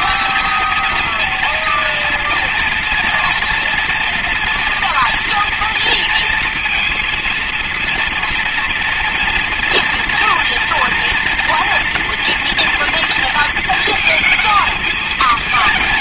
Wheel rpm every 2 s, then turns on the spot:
230, 240, 230, 230, 230, 230, 230, 230.
none